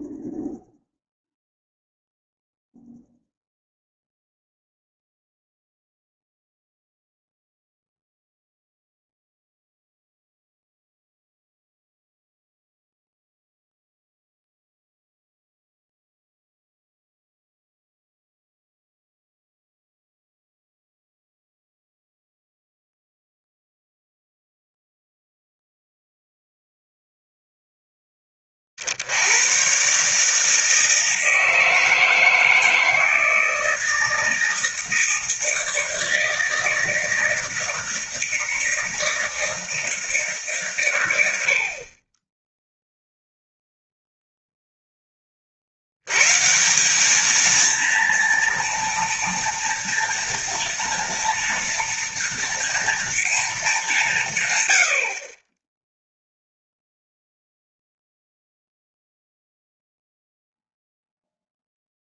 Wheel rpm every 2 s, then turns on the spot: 0, 0, 0, 0, 0, 0, 0, 0, 0, 0, 0, 0, 0, 0, 30, 160, 160, 160, 160, 160, 150, 10, 0, 140, 230, 230, 230, 130, 0, 0, 0.
none